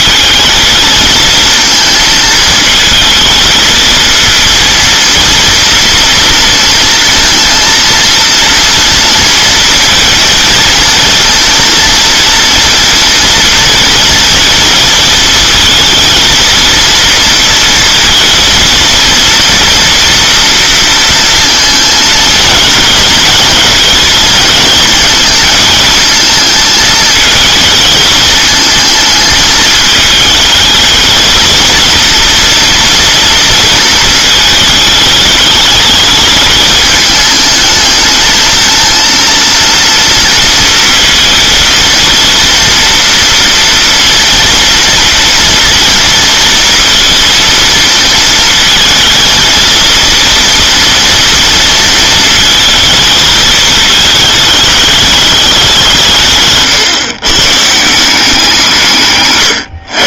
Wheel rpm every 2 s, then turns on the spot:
220, 220, 230, 230, 230, 230, 230, 230, 230, 230, 230, 230, 220, 220, 220, 220, 230, 210, 210, 230, 230, 230, 230, 230, 220, 230, 220, 220, 150, 160.
none